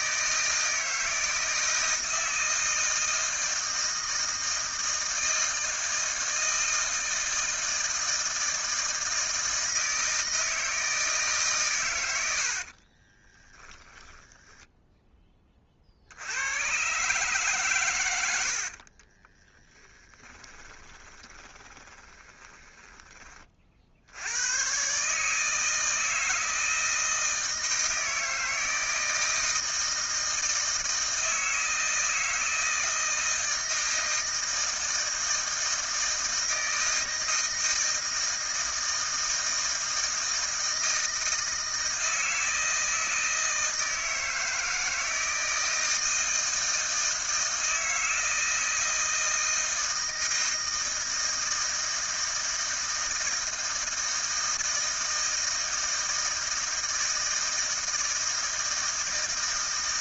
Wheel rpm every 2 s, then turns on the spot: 160, 160, 160, 160, 160, 160, 60, 10, 120, 50, 20, 20, 120, 160, 160, 160, 160, 160, 160, 160, 160, 160, 160, 160, 160, 160, 160, 160, 160, 160.
12-16 18-24